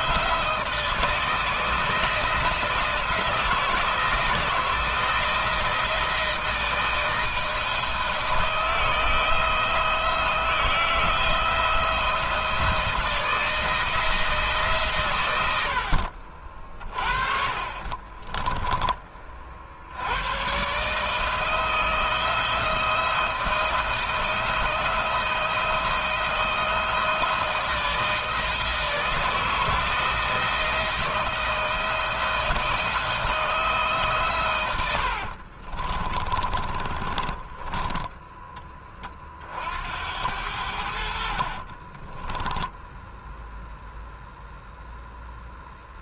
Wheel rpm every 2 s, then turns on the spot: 160, 160, 160, 160, 160, 170, 170, 130, 40, 30, 140, 170, 160, 160, 160, 170, 160, 90, 20, 30, 70, 0, 0.
16-18 34-38 40-42